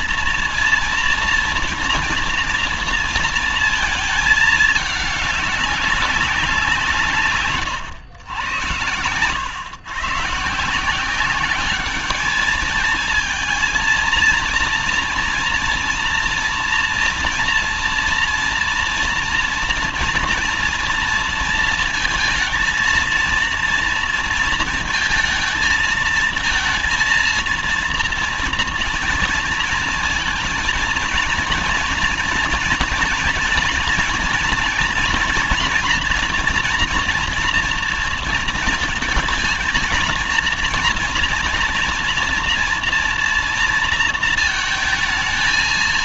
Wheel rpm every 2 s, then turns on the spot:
230, 230, 210, 160, 100, 180, 220, 230, 230, 230, 230, 230, 220, 230, 230, 220, 230, 240, 230, 230, 230, 230, 220.
none